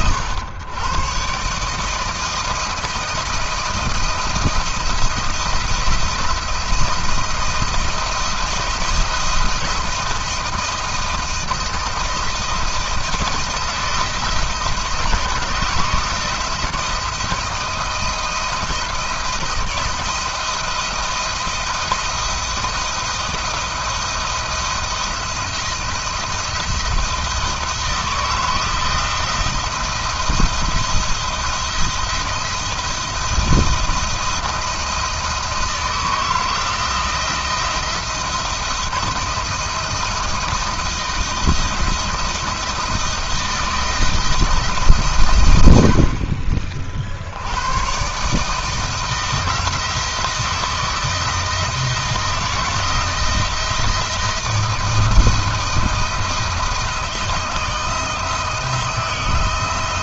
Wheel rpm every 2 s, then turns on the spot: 120, 170, 160, 160, 170, 160, 170, 170, 170, 160, 170, 170, 170, 170, 170, 170, 170, 170, 170, 170, 170, 170, 140, 70, 160, 160, 160, 160, 160, 160.
none